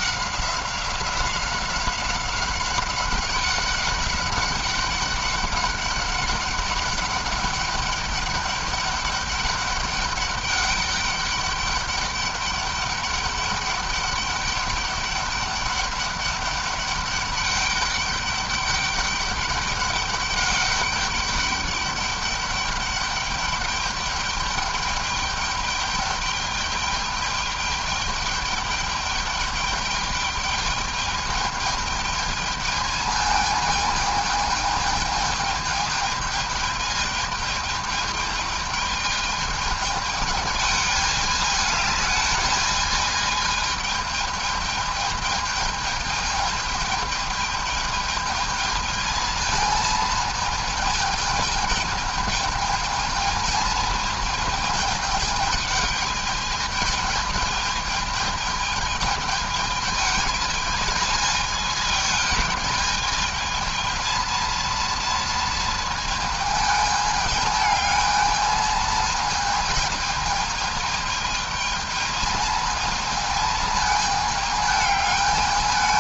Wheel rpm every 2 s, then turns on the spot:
190, 190, 200, 200, 200, 200, 200, 200, 200, 200, 200, 200, 210, 210, 210, 210, 220, 210, 210, 210, 220, 220, 220, 210, 220, 220, 220, 220, 220, 220, 220, 220, 230, 220, 220, 220, 220, 210.
none